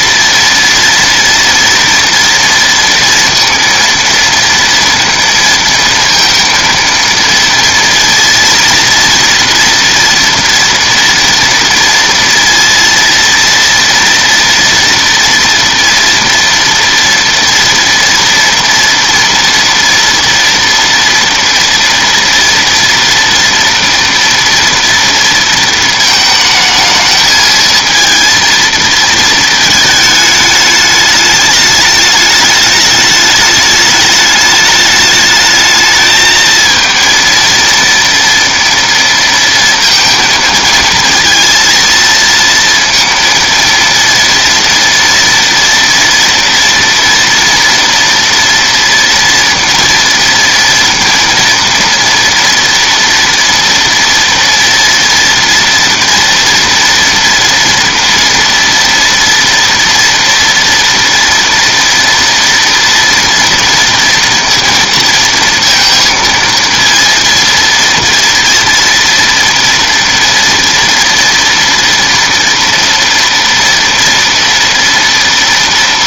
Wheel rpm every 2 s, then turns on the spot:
230, 230, 230, 230, 230, 230, 230, 240, 230, 230, 230, 230, 230, 220, 230, 210, 210, 210, 220, 230, 220, 230, 230, 230, 230, 230, 230, 230, 230, 230, 230, 230, 230, 230, 230, 230, 230, 230.
none